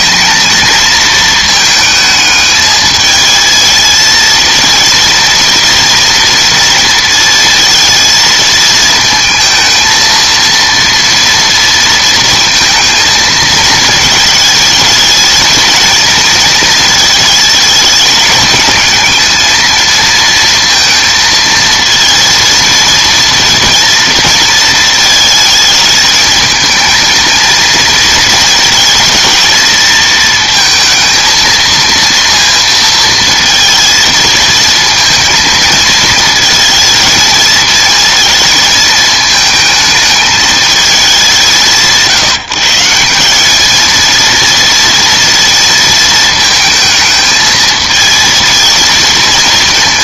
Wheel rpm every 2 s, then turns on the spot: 230, 220, 230, 230, 220, 230, 230, 220, 230, 220, 230, 230, 220, 220, 220, 230, 230, 220, 220, 220, 210, 170, 230, 220, 230.
none